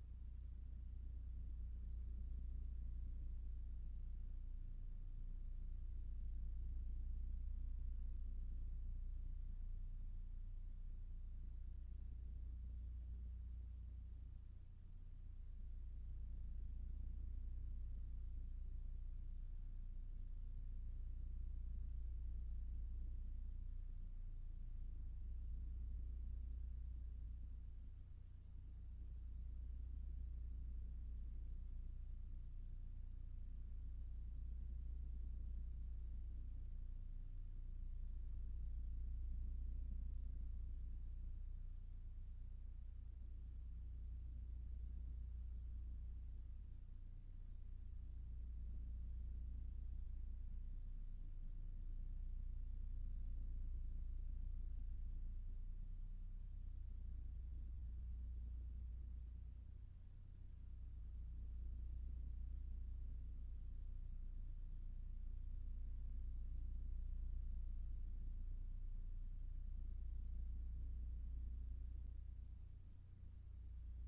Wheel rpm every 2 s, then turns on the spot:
0, 0, 0, 0, 0, 0, 0, 0, 0, 0, 0, 0, 0, 0, 0, 0, 0, 0, 0, 0, 0, 0, 0, 0, 0, 0, 0, 0, 0, 0, 0, 0, 0, 0, 0, 0, 0.
none